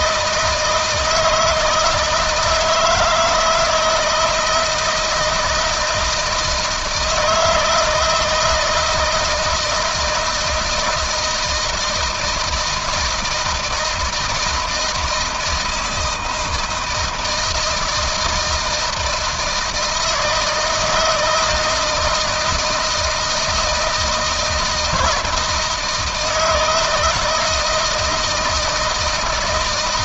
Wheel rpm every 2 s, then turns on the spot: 160, 160, 160, 160, 160, 160, 160, 160, 160, 160, 160, 160, 160, 160, 170.
none